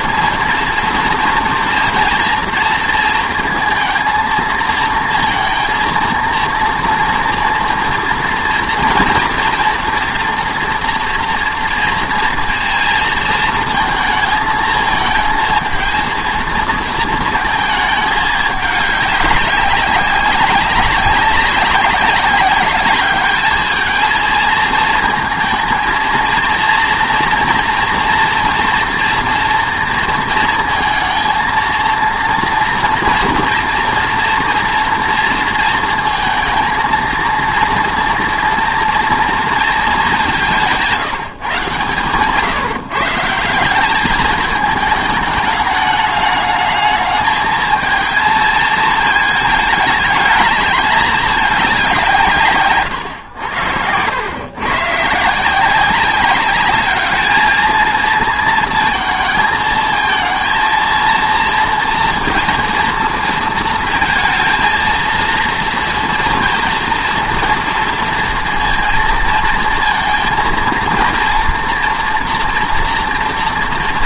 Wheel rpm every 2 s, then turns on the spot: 230, 230, 230, 230, 230, 230, 230, 220, 230, 200, 190, 200, 230, 230, 230, 230, 230, 230, 230, 230, 180, 150, 210, 210, 220, 210, 140, 130, 210, 230, 230, 230, 230, 230, 230, 230, 230.
none